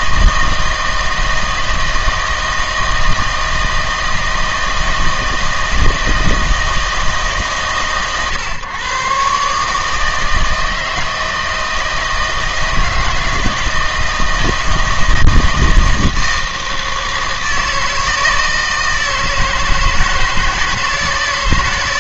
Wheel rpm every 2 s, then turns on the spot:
160, 160, 160, 160, 120, 160, 160, 160, 160, 160, 160.
none